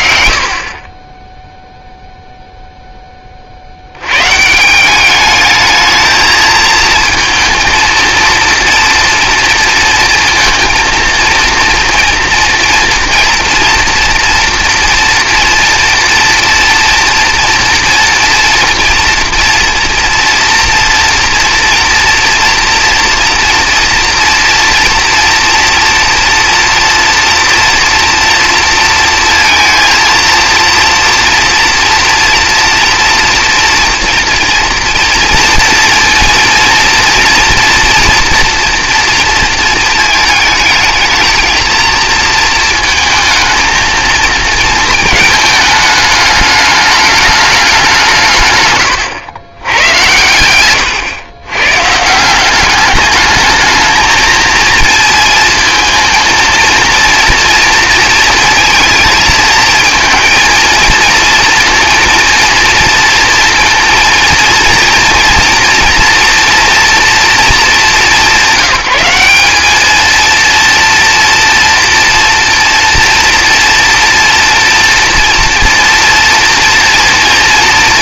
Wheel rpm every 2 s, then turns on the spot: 140, 0, 140, 220, 230, 230, 230, 230, 230, 230, 230, 230, 230, 230, 240, 230, 230, 230, 230, 230, 220, 230, 220, 210, 140, 110, 190, 230, 230, 230, 220, 230, 230, 230, 180, 230, 230, 240, 230.
none